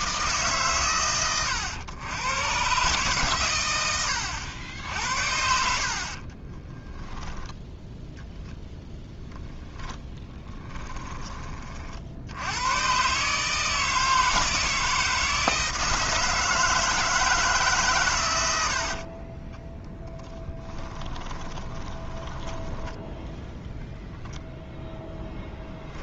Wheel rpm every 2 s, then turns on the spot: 120, 130, 80, 10, 0, 10, 120, 160, 160, 60, 10, 10, 0.
6-8 20-22